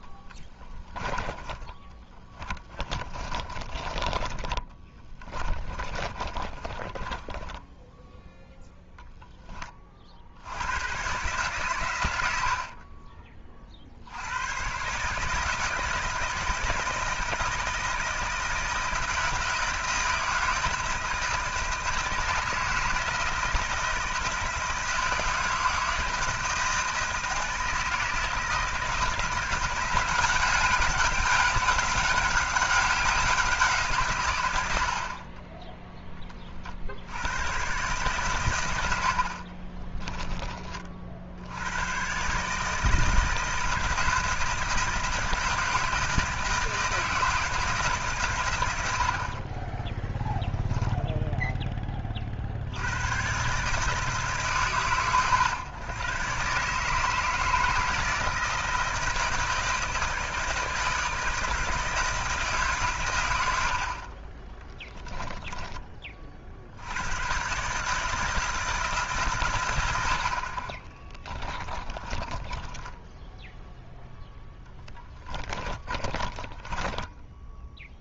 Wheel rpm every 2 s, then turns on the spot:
20, 20, 20, 20, 0, 100, 50, 130, 160, 160, 160, 160, 160, 160, 160, 200, 190, 90, 70, 90, 40, 150, 160, 160, 80, 10, 90, 130, 150, 160, 160, 140, 20, 80, 160, 30, 10, 10, 20.
2-8 12-14 64-66 72-78